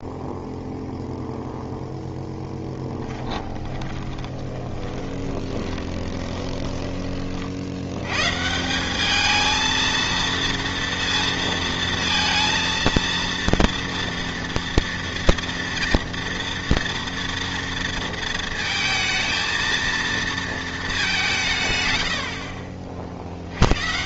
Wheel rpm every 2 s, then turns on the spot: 0, 10, 20, 10, 180, 230, 230, 230, 230, 230, 220, 50.
2-8